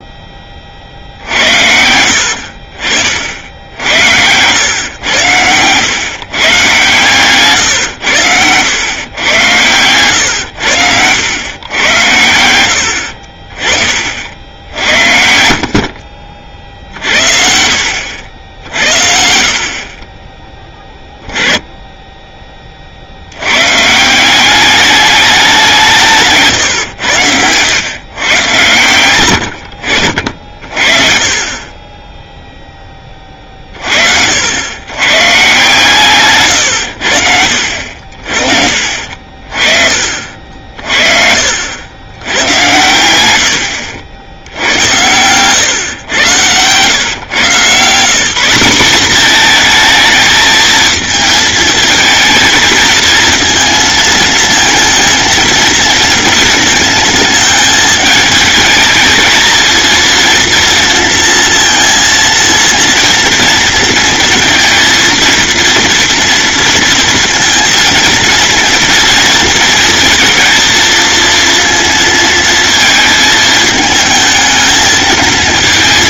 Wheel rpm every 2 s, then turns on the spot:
50, 40, 110, 130, 100, 100, 80, 70, 50, 60, 10, 40, 210, 120, 100, 40, 10, 110, 110, 60, 50, 100, 100, 120, 200, 220, 220, 220, 220, 220, 230, 230, 220, 230, 230, 230, 220, 220.
14-18